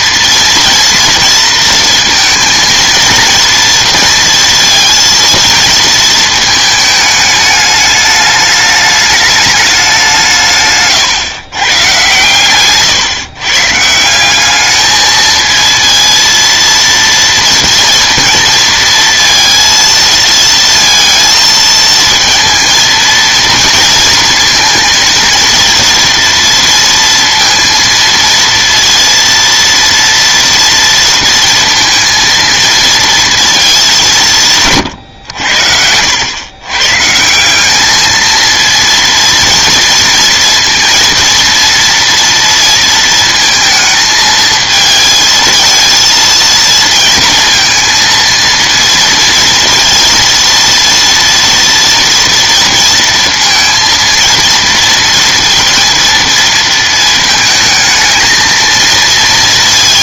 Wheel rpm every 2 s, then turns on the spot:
240, 230, 230, 220, 210, 140, 130, 210, 230, 230, 230, 230, 230, 230, 230, 230, 230, 140, 120, 230, 230, 230, 220, 230, 230, 230, 230, 230, 220, 230.
10-12